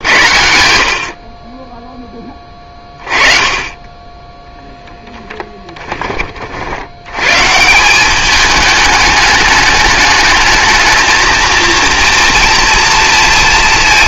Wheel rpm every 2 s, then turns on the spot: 70, 20, 0, 60, 210, 220, 230.
none